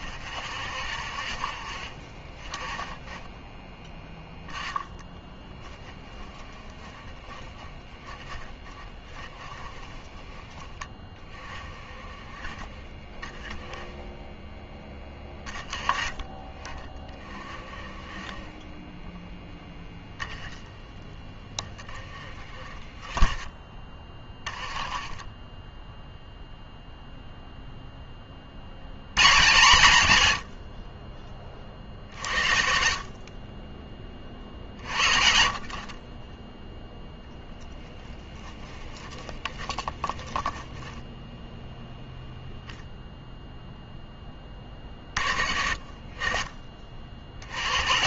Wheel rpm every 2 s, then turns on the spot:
50, 20, 0, 20, 20, 10, 30, 10, 30, 10, 10, 20, 20, 0, 90, 40, 50, 50, 0, 20, 10, 0, 40, 30.
6-10 38-40